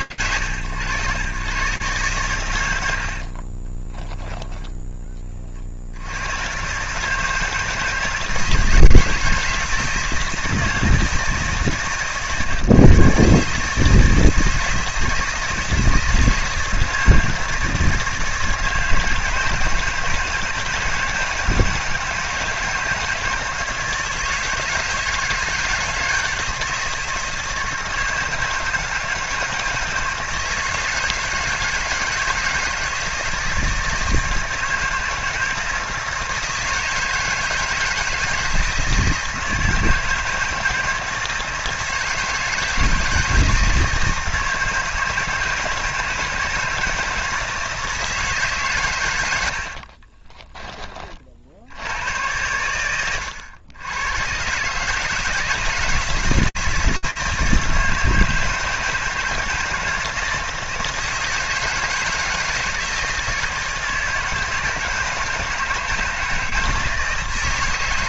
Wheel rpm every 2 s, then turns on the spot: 100, 80, 20, 140, 160, 160, 140, 160, 160, 160, 160, 160, 160, 160, 160, 160, 160, 160, 160, 160, 160, 160, 160, 160, 100, 40, 100, 150, 160, 160, 160, 160, 160, 160.
2-4